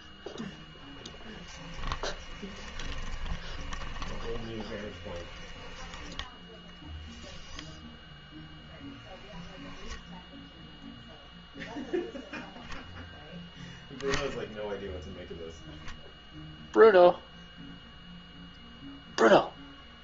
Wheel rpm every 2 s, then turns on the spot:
10, 20, 20, 0, 0, 0, 10, 0, 0, 0.
0-6